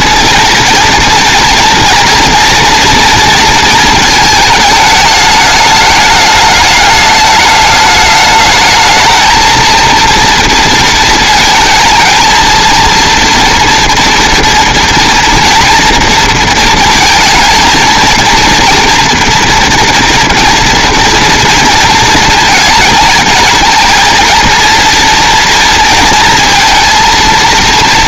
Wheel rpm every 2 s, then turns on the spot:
230, 230, 220, 210, 220, 230, 230, 230, 220, 230, 240, 220, 230, 230.
none